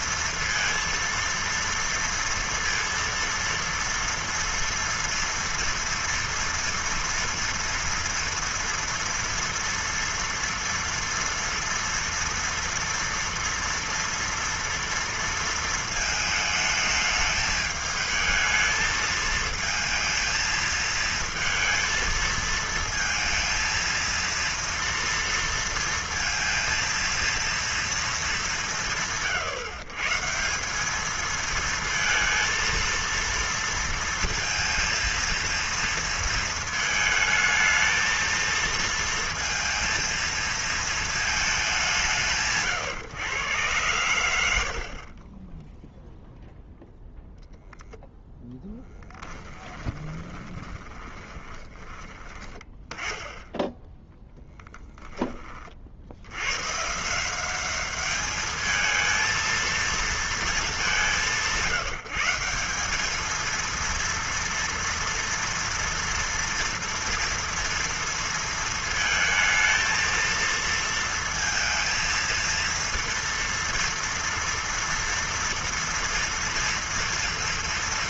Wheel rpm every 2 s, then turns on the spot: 230, 230, 230, 230, 230, 230, 230, 230, 220, 220, 230, 230, 230, 230, 130, 200, 230, 230, 220, 230, 230, 140, 50, 0, 10, 30, 20, 10, 150, 220, 200, 210, 230, 240, 220, 230, 230, 230, 230.
48-52